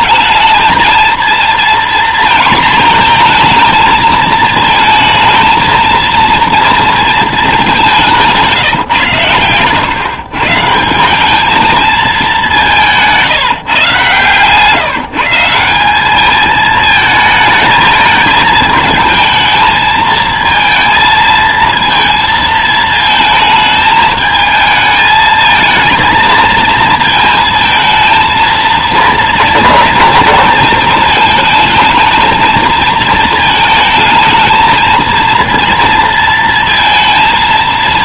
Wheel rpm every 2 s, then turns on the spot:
220, 230, 220, 230, 150, 160, 180, 160, 220, 220, 230, 220, 220, 230, 230, 230, 230, 220, 230.
none